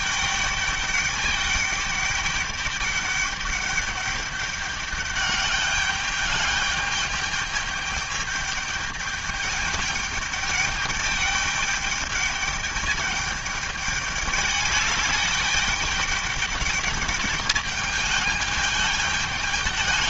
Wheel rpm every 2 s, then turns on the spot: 210, 200, 200, 210, 210, 210, 210, 210, 210, 210.
none